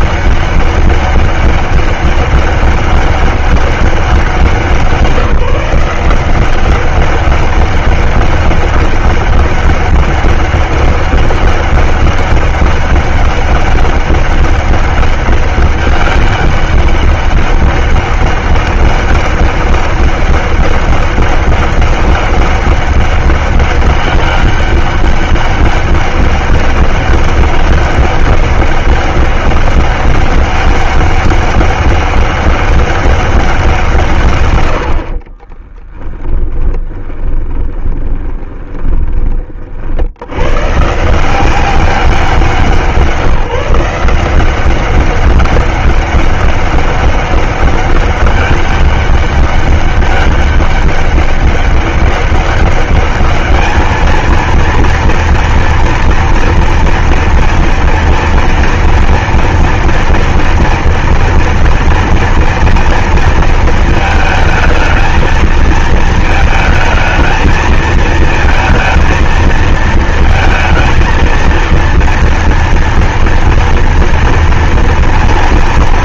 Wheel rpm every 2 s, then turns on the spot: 200, 200, 190, 180, 200, 200, 200, 200, 200, 200, 200, 200, 200, 190, 200, 200, 200, 140, 10, 20, 90, 190, 170, 200, 200, 200, 200, 220, 230, 230, 230, 230, 220, 220, 230, 230, 230, 230.
36-40